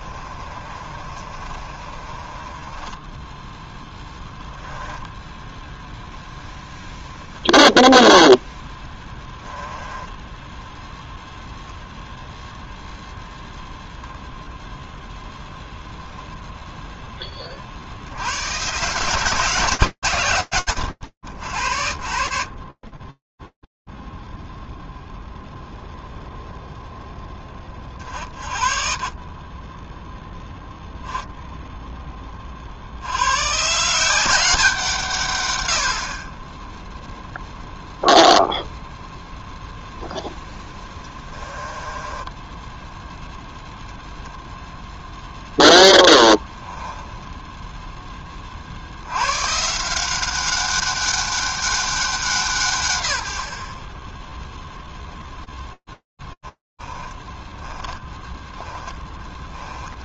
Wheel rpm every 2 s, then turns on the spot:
40, 10, 0, 0, 10, 0, 0, 0, 30, 120, 30, 0, 20, 10, 0, 90, 170, 0, 0, 10, 10, 0, 10, 20, 180, 200, 40, 20, 10, 20.
0-2 8-10 38-42 44-46 54-60